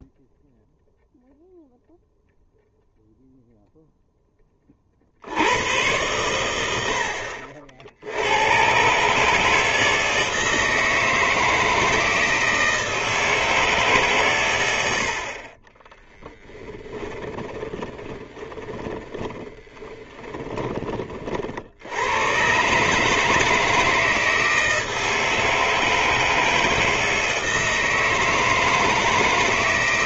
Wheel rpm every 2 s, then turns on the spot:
0, 0, 10, 100, 70, 160, 160, 120, 10, 20, 20, 120, 160, 160, 160.
16-22